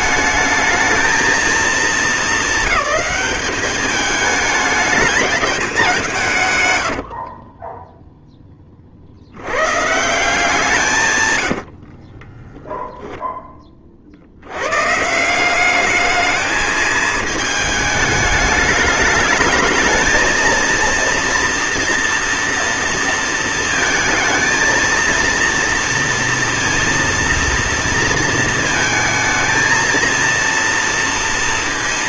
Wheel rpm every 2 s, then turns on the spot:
220, 210, 200, 30, 140, 60, 20, 190, 220, 220, 230, 230, 230, 230, 230, 230.
6-8 10-12